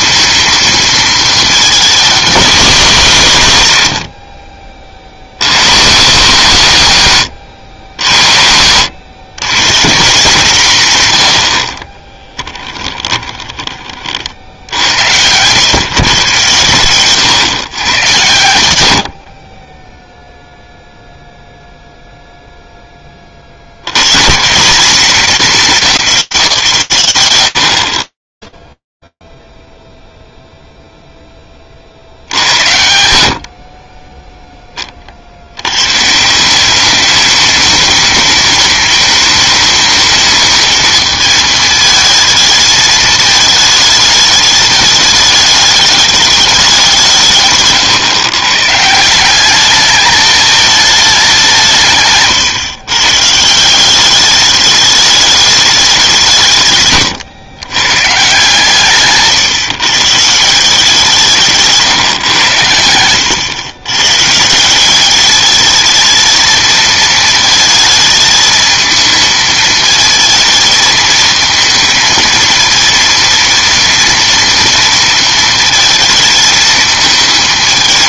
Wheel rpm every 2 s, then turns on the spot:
230, 200, 50, 180, 90, 160, 10, 60, 110, 110, 0, 0, 160, 160, 10, 0, 80, 30, 200, 220, 220, 220, 210, 190, 160, 210, 140, 210, 150, 140, 160, 100, 200, 220, 220, 220, 230, 230, 220.
12-14 56-58